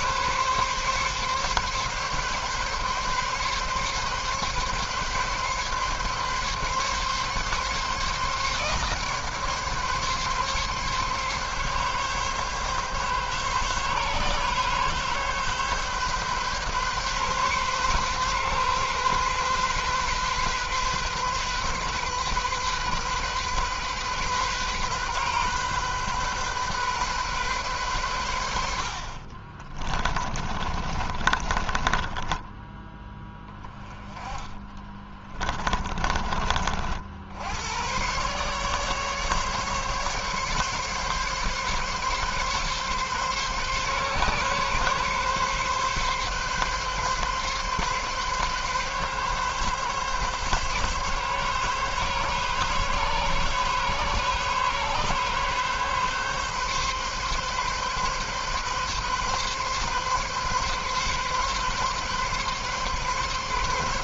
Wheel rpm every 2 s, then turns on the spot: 140, 140, 140, 140, 140, 140, 140, 130, 140, 130, 130, 130, 130, 130, 90, 30, 10, 20, 40, 140, 140, 140, 140, 140, 140, 140, 140, 140, 140, 140, 130, 140.
30-36